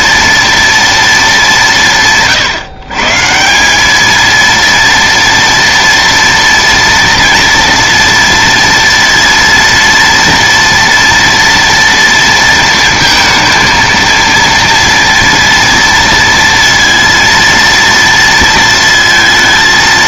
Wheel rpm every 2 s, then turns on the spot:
230, 140, 230, 240, 230, 230, 230, 230, 230, 230.
none